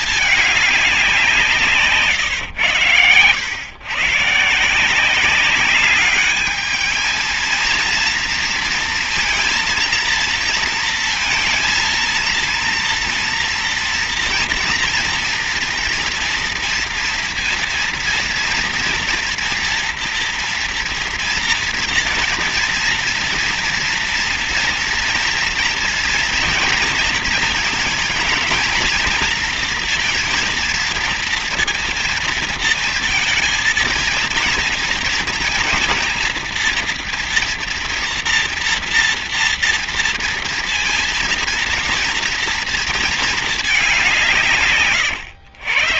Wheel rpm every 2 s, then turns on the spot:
210, 110, 140, 210, 230, 230, 230, 230, 240, 230, 230, 230, 240, 230, 230, 230, 230, 230, 230, 240, 230, 230, 160.
none